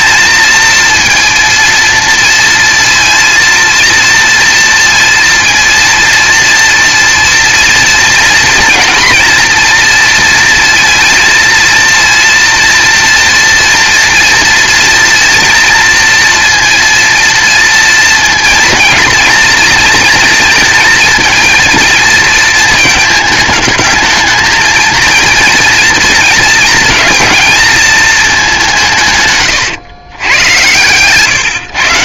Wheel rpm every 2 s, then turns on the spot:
230, 230, 230, 230, 230, 230, 240, 240, 230, 230, 230, 220, 230, 230, 160, 120.
none